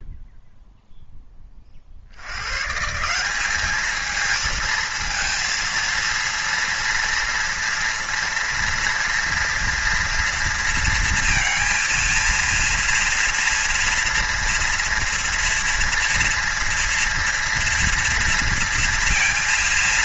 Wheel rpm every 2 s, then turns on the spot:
0, 120, 220, 230, 230, 230, 230, 230, 230, 230.
none